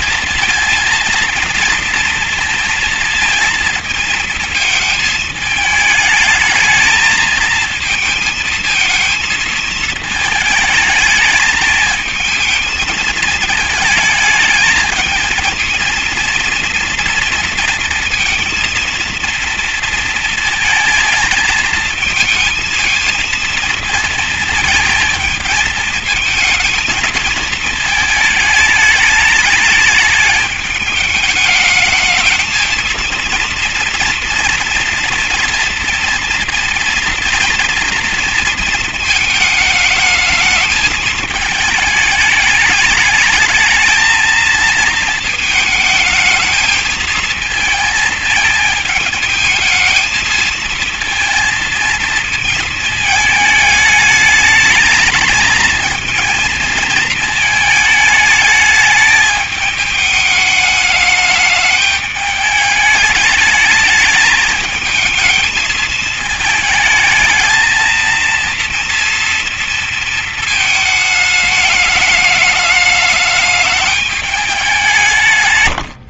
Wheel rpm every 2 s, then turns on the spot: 230, 230, 220, 210, 220, 220, 220, 220, 230, 230, 230, 220, 220, 230, 210, 210, 220, 230, 230, 230, 220, 210, 220, 220, 220, 220, 220, 220, 220, 210, 210, 210, 220, 220, 230, 220, 210, 210.
none